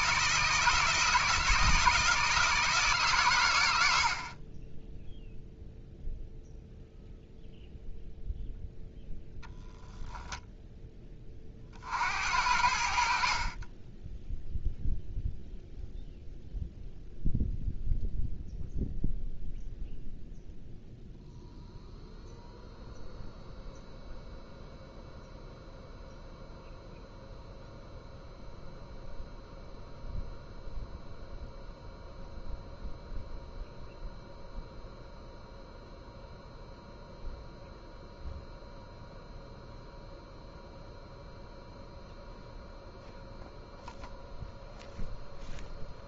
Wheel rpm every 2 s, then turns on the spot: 160, 150, 10, 0, 0, 10, 70, 0, 0, 0, 0, 0, 0, 0, 0, 0, 0, 0, 0, 0, 0, 0, 0.
none